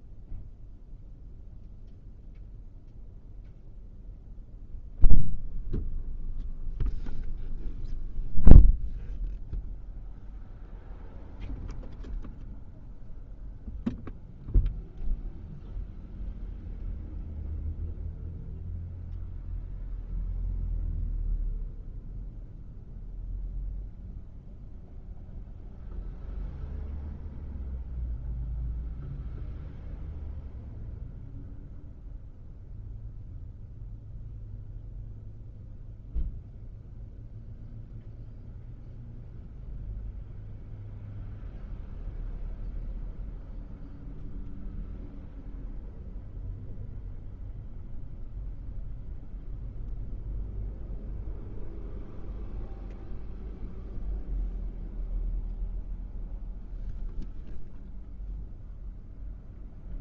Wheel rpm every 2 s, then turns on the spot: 0, 0, 0, 0, 0, 0, 0, 0, 0, 0, 0, 0, 0, 0, 0, 0, 0, 0, 0, 0, 0, 0, 0, 0, 0, 0, 0, 0, 0, 0.
none